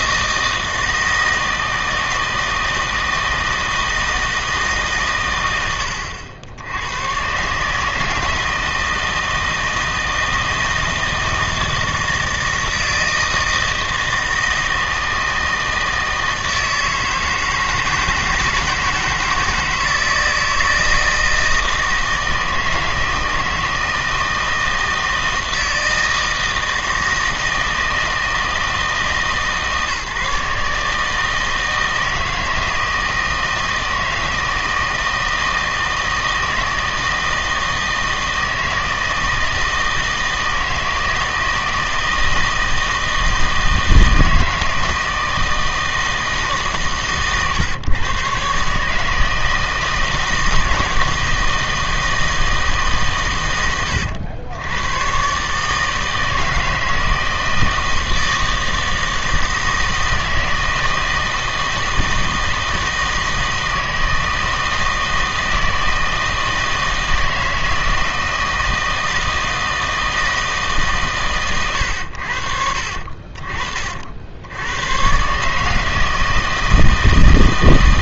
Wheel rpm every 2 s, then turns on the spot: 160, 160, 150, 110, 160, 160, 160, 160, 160, 160, 160, 160, 160, 160, 160, 150, 160, 160, 160, 160, 160, 160, 160, 150, 150, 160, 150, 100, 160, 160, 160, 160, 160, 160, 160, 150, 60, 100, 160.
none